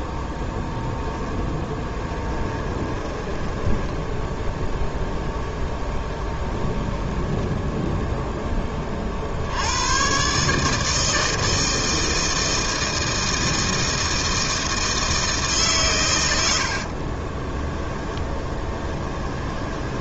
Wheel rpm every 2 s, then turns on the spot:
10, 20, 0, 0, 20, 150, 160, 160, 60, 10.
2-4 16-20